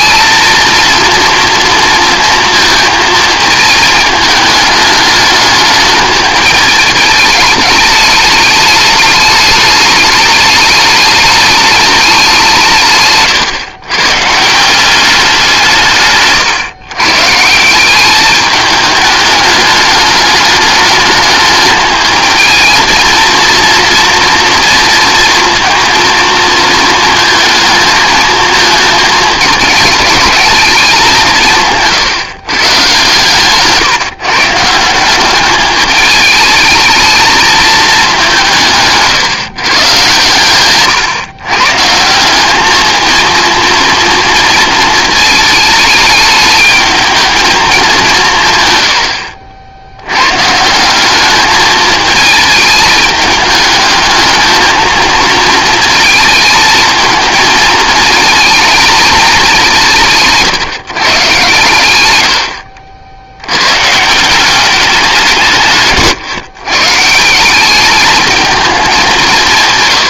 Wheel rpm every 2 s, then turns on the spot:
230, 220, 210, 210, 210, 210, 130, 190, 150, 210, 210, 230, 230, 220, 210, 170, 140, 200, 220, 140, 130, 230, 220, 220, 70, 200, 220, 220, 220, 180, 120, 90, 170, 170, 190.
none